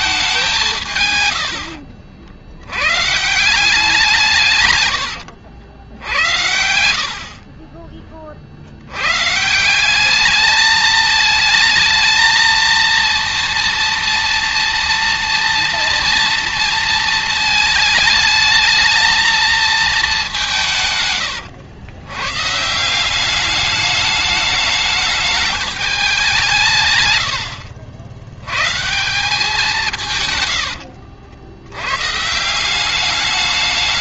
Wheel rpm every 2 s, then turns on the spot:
170, 90, 120, 60, 90, 220, 230, 230, 230, 220, 170, 160, 210, 150, 150, 100, 180.
30-32